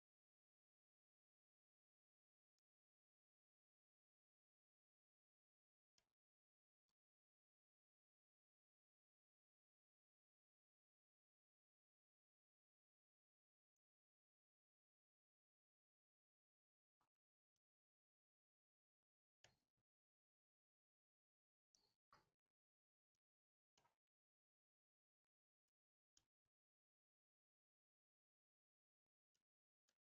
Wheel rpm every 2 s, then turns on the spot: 0, 0, 0, 0, 0, 0, 0, 0, 0, 0, 0, 0, 0, 0, 0.
none